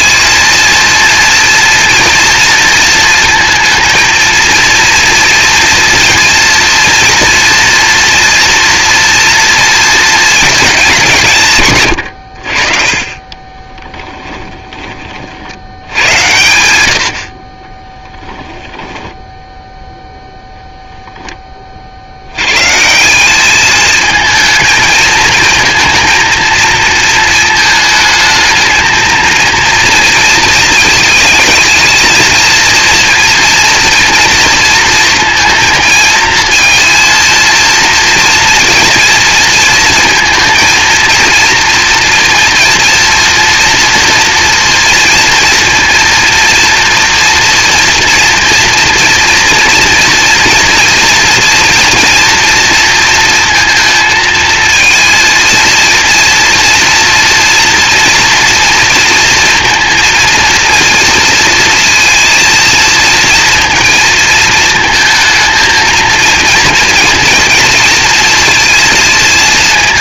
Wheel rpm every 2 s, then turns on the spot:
230, 230, 230, 230, 230, 190, 30, 30, 100, 10, 0, 160, 220, 220, 220, 220, 230, 230, 230, 230, 230, 230, 230, 230, 230, 230, 230, 230, 230, 230, 230, 230, 220, 230, 220.
none